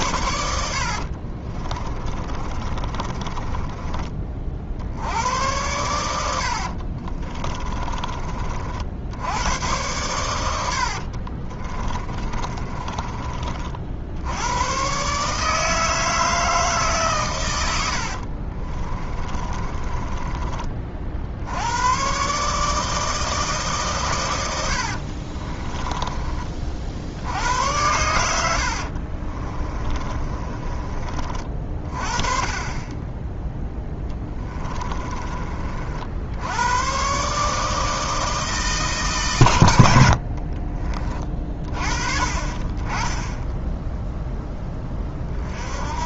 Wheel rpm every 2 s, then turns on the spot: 60, 30, 70, 50, 50, 70, 30, 110, 150, 30, 30, 150, 80, 50, 70, 30, 20, 20, 110, 160, 40, 30, 10.
0-4 6-8 10-14 18-20 24-26 28-32 34-36 40-42